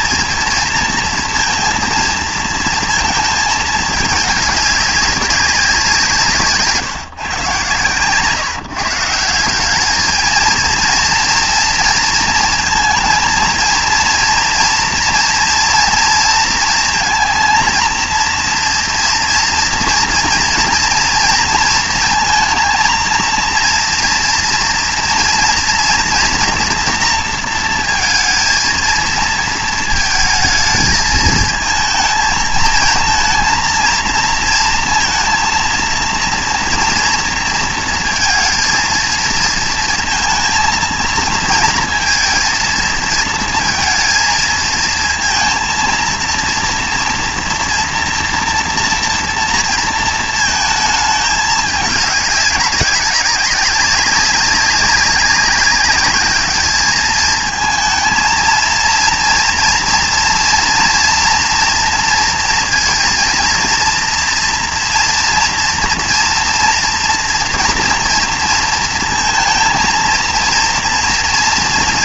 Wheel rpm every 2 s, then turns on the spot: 230, 230, 200, 150, 150, 230, 230, 230, 230, 240, 230, 220, 230, 230, 230, 220, 220, 230, 230, 230, 230, 230, 230, 230, 230, 230, 200, 200, 210, 230, 230, 230, 230, 230, 230, 230.
none